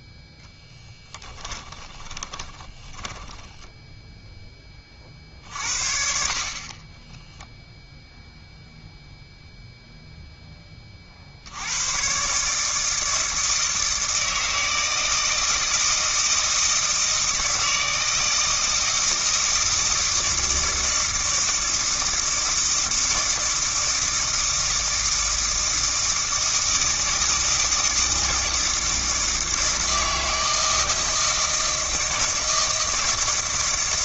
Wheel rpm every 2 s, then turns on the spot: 10, 20, 30, 10, 0, 20, 160, 160, 160, 160, 160, 160, 160, 160, 160, 160, 160.
0-4